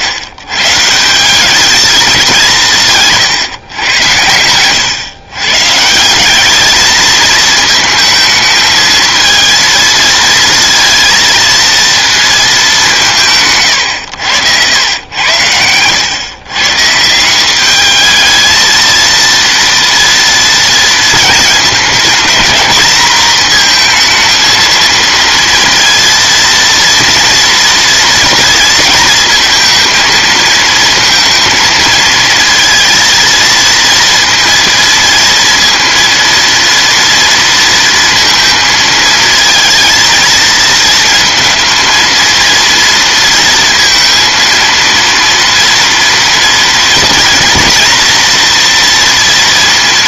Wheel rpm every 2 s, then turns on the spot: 140, 170, 110, 210, 220, 230, 200, 100, 150, 220, 230, 220, 230, 230, 230, 230, 230, 230, 230, 230, 230, 230, 230, 230, 230.
none